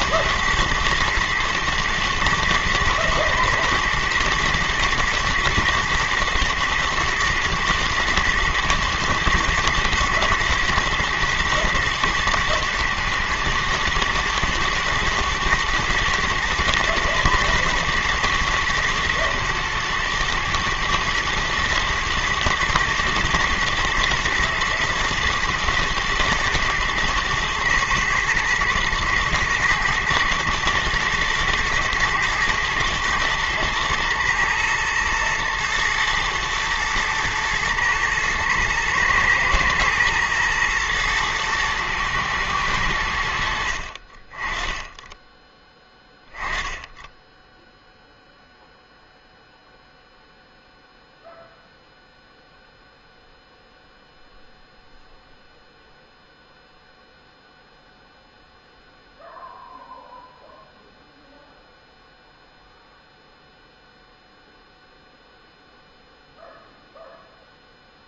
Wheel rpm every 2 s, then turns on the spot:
110, 110, 120, 120, 110, 110, 120, 110, 110, 120, 120, 110, 110, 110, 110, 110, 110, 110, 110, 110, 110, 100, 20, 10, 0, 0, 0, 0, 0, 0, 0, 0, 0, 0.
none